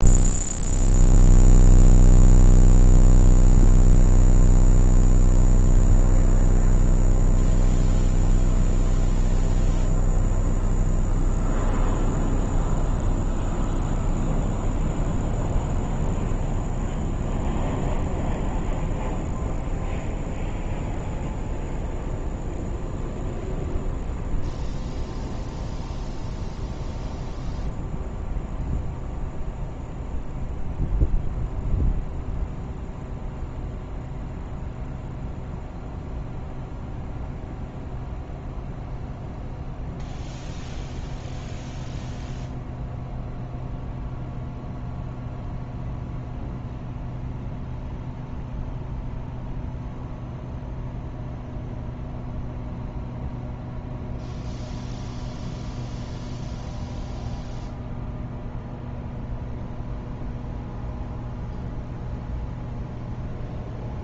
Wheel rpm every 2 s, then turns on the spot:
0, 0, 0, 0, 0, 0, 0, 0, 0, 0, 0, 0, 0, 0, 0, 0, 0, 0, 0, 0, 0, 0, 0, 0, 0, 0, 0, 0, 0, 0, 0, 0.
none